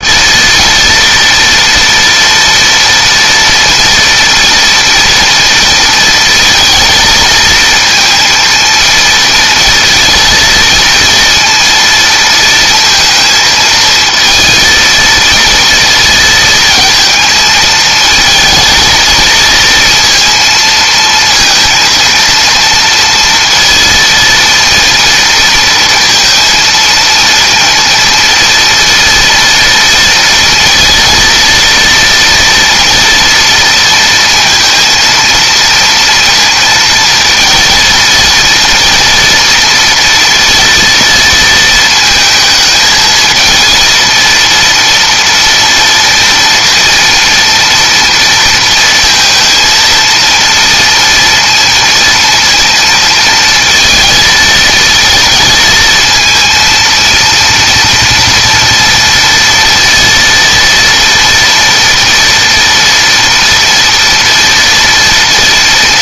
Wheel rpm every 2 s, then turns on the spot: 230, 230, 230, 230, 230, 230, 230, 230, 220, 220, 230, 230, 230, 230, 230, 230, 230, 230, 230, 230, 230, 220, 230, 240, 230, 230, 230, 230, 230, 230, 230, 240, 230.
none